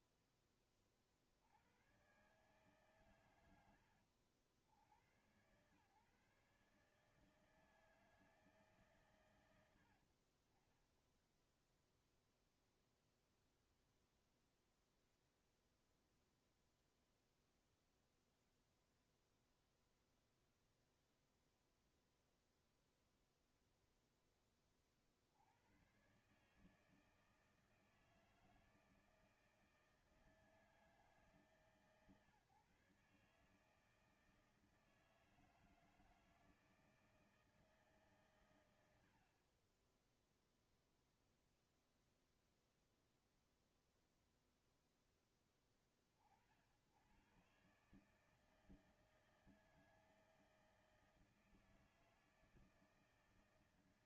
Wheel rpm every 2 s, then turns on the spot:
30, 120, 90, 140, 160, 60, 0, 0, 0, 0, 0, 0, 10, 130, 160, 160, 150, 160, 160, 130, 10, 0, 0, 50, 150, 160, 160.
none